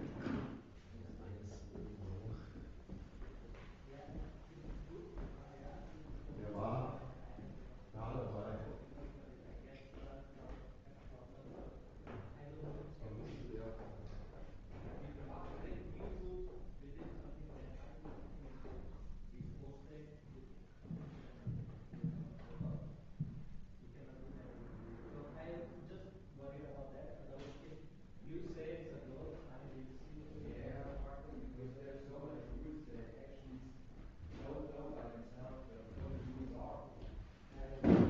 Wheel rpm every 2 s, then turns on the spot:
0, 0, 0, 0, 0, 0, 0, 0, 0, 0, 0, 0, 0, 0, 0, 0, 0, 0, 0.
none